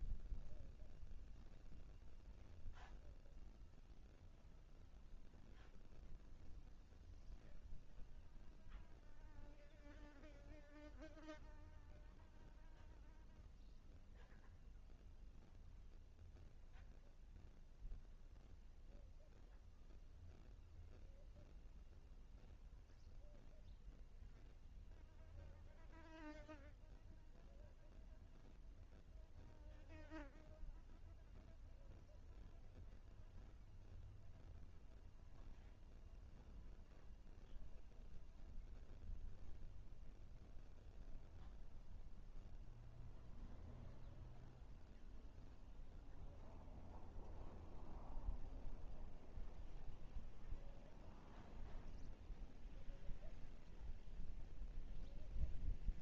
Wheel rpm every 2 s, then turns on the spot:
0, 0, 0, 0, 0, 0, 0, 0, 0, 0, 0, 0, 0, 0, 0, 0, 0, 0, 0, 0, 0, 0, 0, 0, 0, 0, 0, 0.
none